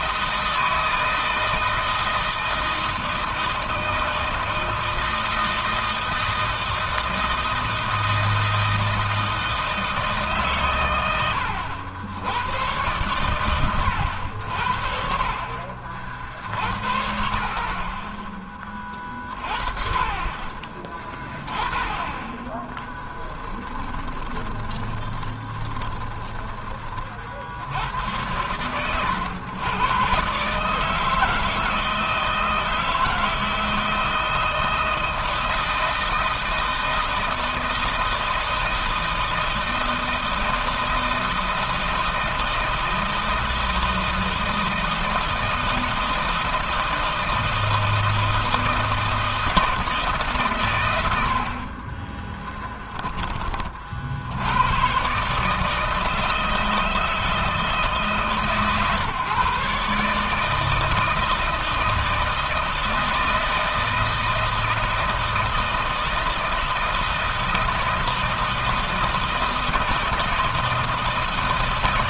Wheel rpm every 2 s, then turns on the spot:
160, 160, 160, 160, 160, 110, 120, 60, 40, 30, 20, 10, 20, 30, 100, 150, 160, 160, 160, 160, 160, 160, 160, 160, 160, 100, 10, 120, 160, 130, 160, 160, 160, 160, 160, 160.
22-26